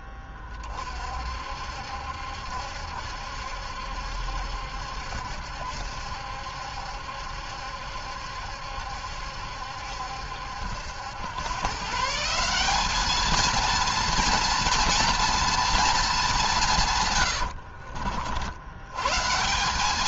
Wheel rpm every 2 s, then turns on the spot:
30, 70, 70, 70, 70, 80, 180, 230, 170, 80.
none